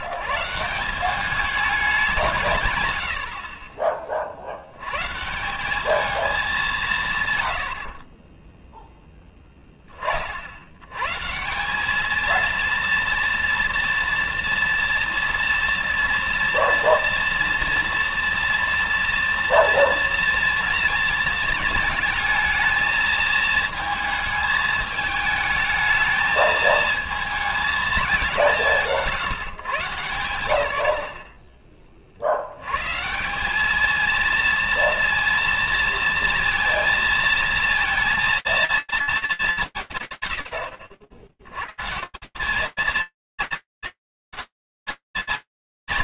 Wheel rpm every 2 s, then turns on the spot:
130, 170, 60, 210, 20, 90, 230, 230, 230, 230, 230, 220, 210, 220, 140, 90, 140, 230, 230, 230, 90, 160, 220.
8-10